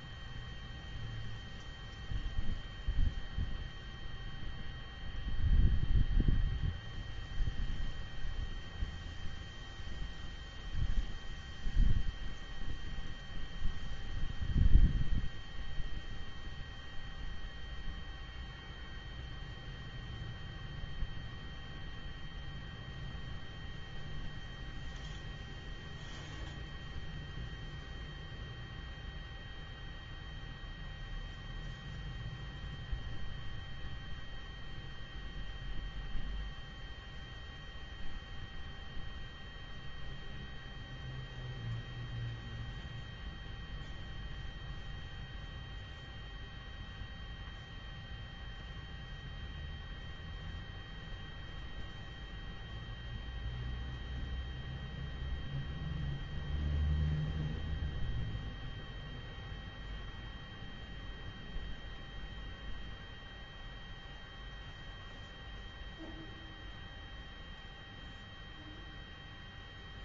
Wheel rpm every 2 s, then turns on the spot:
0, 0, 0, 0, 0, 0, 0, 0, 0, 0, 0, 0, 0, 0, 0, 0, 0, 0, 0, 0, 0, 0, 0, 0, 0, 0, 0, 0, 0, 0, 0, 0, 0, 0, 0.
none